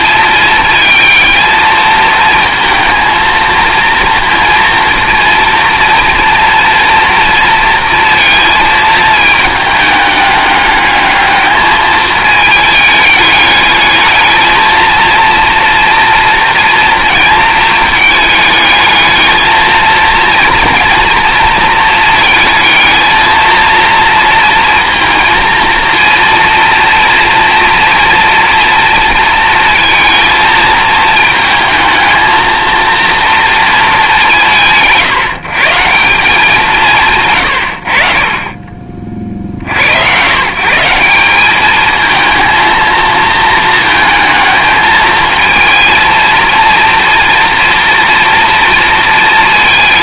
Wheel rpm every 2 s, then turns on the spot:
220, 230, 230, 230, 210, 220, 220, 230, 210, 230, 220, 230, 230, 230, 230, 220, 200, 180, 40, 110, 220, 220, 230, 230, 230.
none